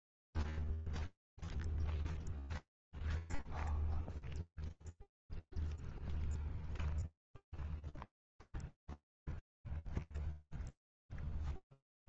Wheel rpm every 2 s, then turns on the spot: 0, 0, 0, 0, 0, 0.
none